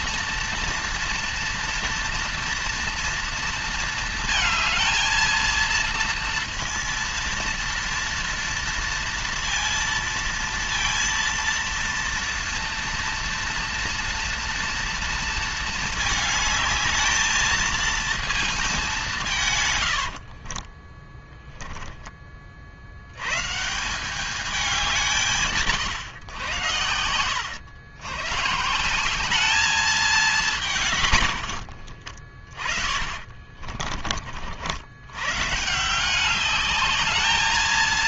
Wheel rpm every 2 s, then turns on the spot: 230, 230, 220, 230, 230, 230, 230, 230, 220, 220, 50, 40, 200, 120, 140, 190, 20, 70, 200.
20-22